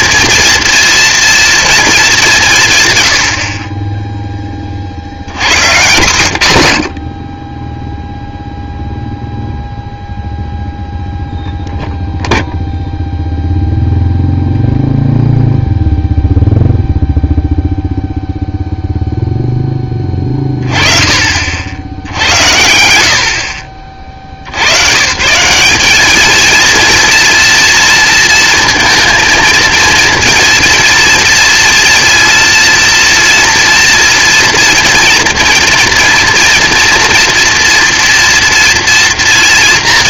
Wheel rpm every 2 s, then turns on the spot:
230, 160, 40, 70, 0, 0, 0, 0, 0, 0, 20, 70, 90, 230, 230, 230, 230, 230, 240, 230.
none